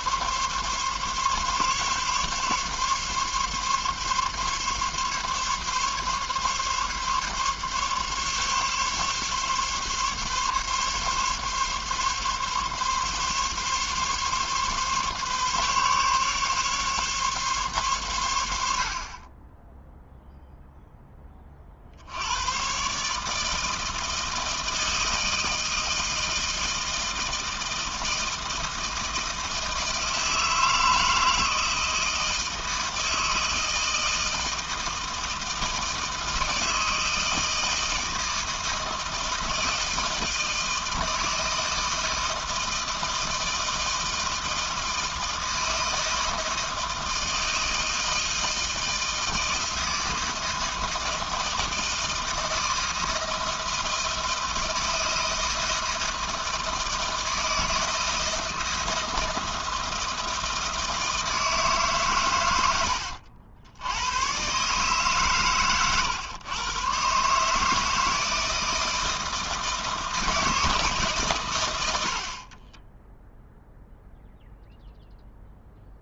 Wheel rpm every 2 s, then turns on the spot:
140, 140, 140, 140, 140, 140, 140, 140, 140, 60, 0, 130, 160, 160, 160, 160, 160, 160, 160, 160, 160, 160, 160, 160, 160, 160, 160, 160, 160, 160, 160, 90, 140, 120, 160, 150, 20, 0.
62-64 72-74